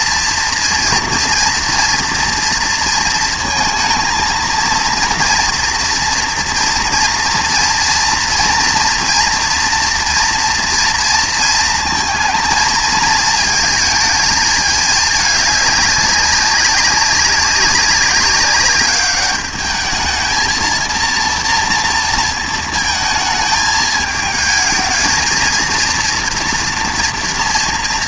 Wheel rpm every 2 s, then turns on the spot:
230, 230, 230, 230, 240, 230, 220, 220, 200, 200, 230, 220, 220, 230.
none